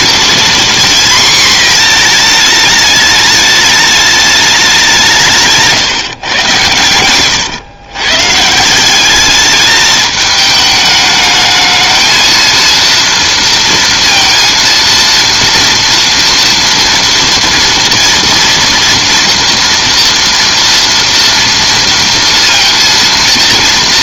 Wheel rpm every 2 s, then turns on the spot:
240, 210, 190, 110, 190, 210, 230, 230, 230, 240, 230, 230.
none